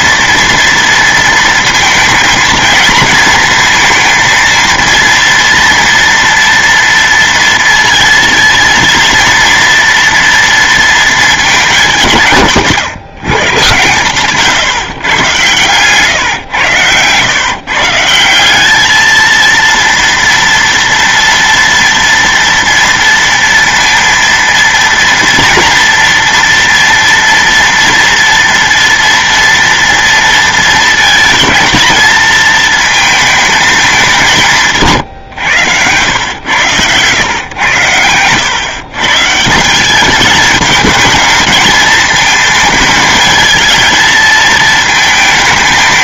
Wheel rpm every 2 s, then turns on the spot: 230, 230, 230, 230, 230, 230, 160, 140, 120, 200, 230, 230, 230, 240, 240, 230, 220, 180, 110, 120, 210, 220, 220.
none